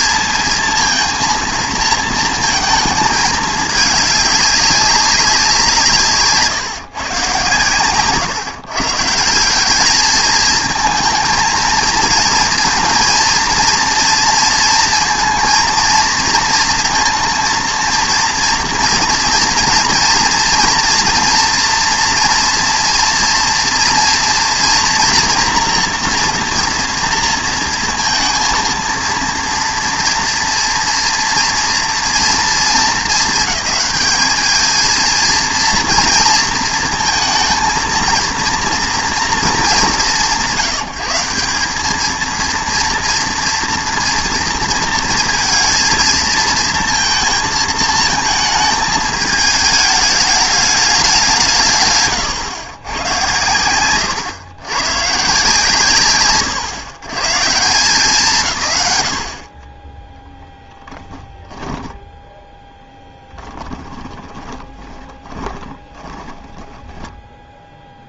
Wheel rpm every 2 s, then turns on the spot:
230, 220, 200, 140, 140, 220, 230, 230, 230, 230, 230, 240, 240, 230, 230, 230, 220, 220, 230, 230, 170, 230, 230, 220, 220, 200, 120, 90, 110, 120, 10, 10, 20, 10.
62-68